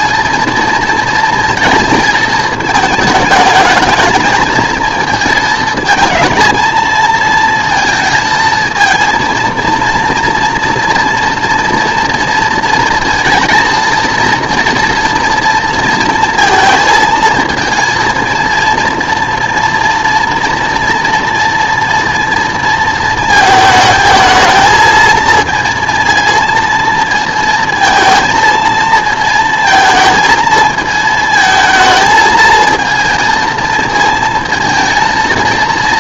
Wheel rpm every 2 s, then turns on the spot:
230, 220, 220, 230, 230, 230, 230, 230, 230, 230, 230, 230, 220, 220, 230, 220, 220, 230.
none